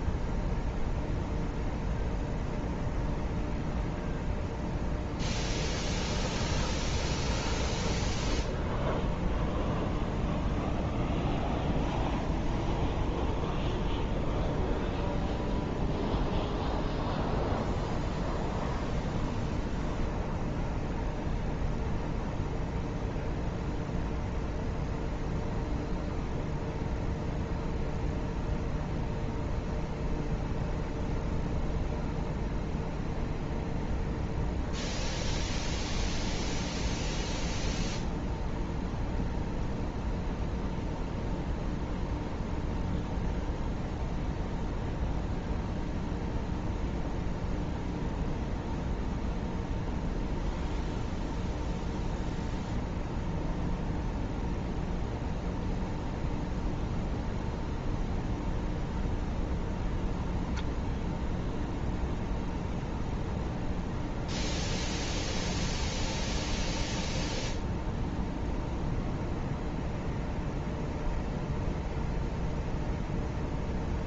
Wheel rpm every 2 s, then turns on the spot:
0, 0, 0, 0, 0, 0, 0, 0, 0, 0, 0, 0, 0, 0, 0, 0, 0, 0, 0, 0, 0, 0, 0, 0, 0, 0, 0, 0, 0, 0, 0, 0, 0, 0, 0, 0, 0.
none